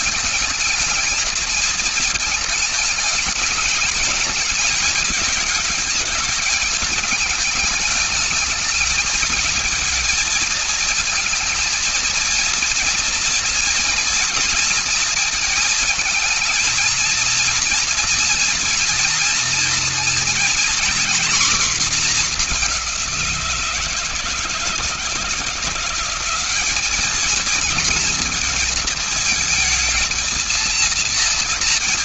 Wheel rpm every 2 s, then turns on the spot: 220, 210, 220, 210, 220, 230, 230, 230, 220, 230, 240, 200, 160, 210, 230, 230.
none